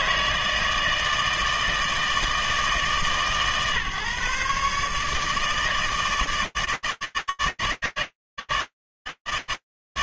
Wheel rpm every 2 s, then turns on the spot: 160, 140, 160, 150, 150.
none